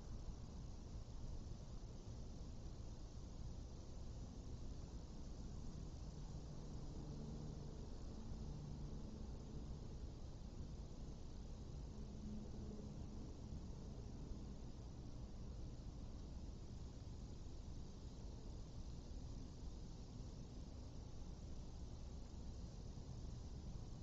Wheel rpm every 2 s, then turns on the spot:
0, 0, 0, 0, 0, 0, 0, 0, 0, 0, 0, 0.
none